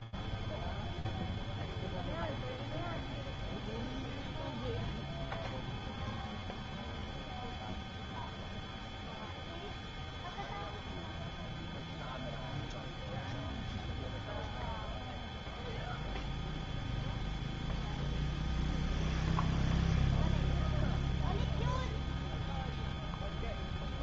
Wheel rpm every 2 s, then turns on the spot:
0, 0, 0, 0, 0, 0, 0, 0, 0, 0, 0, 140.
none